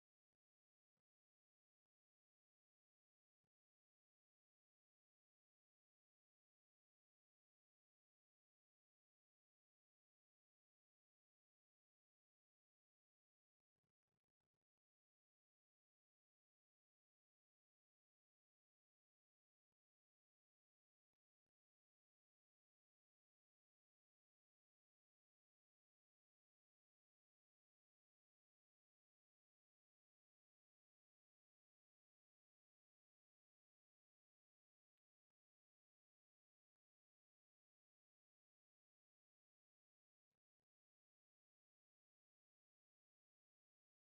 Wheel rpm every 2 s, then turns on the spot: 0, 0, 0, 0, 0, 0, 0, 0, 0, 0, 0, 0, 0, 0, 0, 0, 0, 0, 0, 0, 0, 0.
none